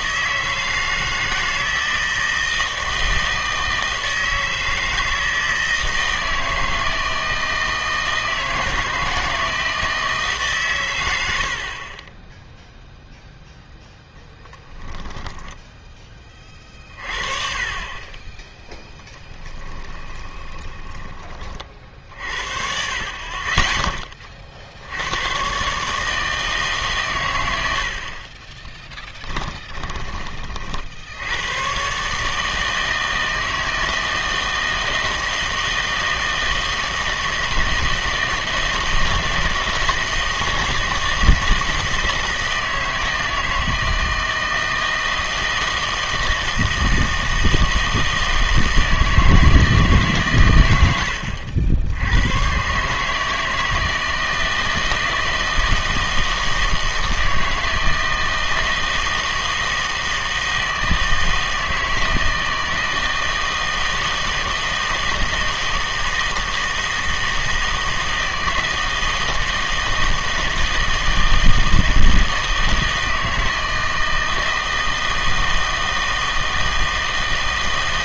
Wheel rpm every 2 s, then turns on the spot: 160, 160, 160, 160, 160, 140, 0, 10, 30, 10, 20, 50, 60, 150, 20, 40, 160, 160, 160, 160, 160, 160, 160, 160, 160, 110, 120, 160, 160, 160, 160, 160, 160, 160, 160, 160, 160, 160, 160.
20-22 28-30